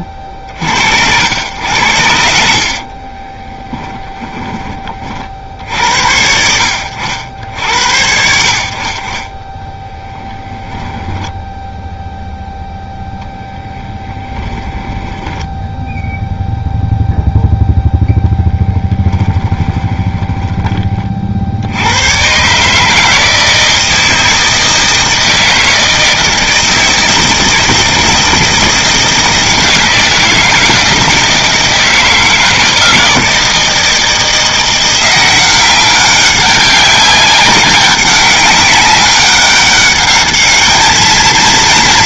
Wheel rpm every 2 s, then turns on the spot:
50, 60, 20, 80, 60, 10, 0, 10, 0, 10, 20, 140, 160, 160, 160, 160, 160, 170, 190, 200, 210.
2-4 10-12 14-16